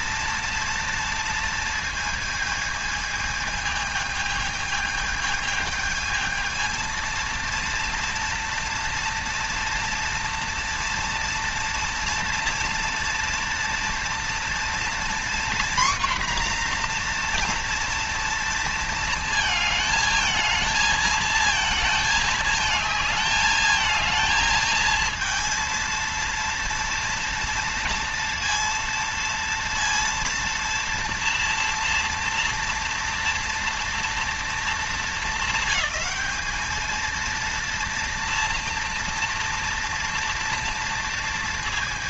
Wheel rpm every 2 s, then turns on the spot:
230, 220, 220, 220, 230, 230, 230, 230, 250, 230, 220, 220, 220, 230, 230, 230, 230, 220, 210, 230, 230.
none